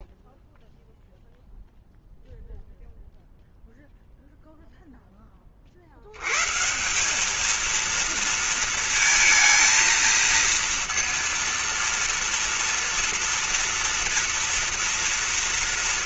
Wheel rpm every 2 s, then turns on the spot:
0, 0, 0, 130, 230, 230, 230, 230.
none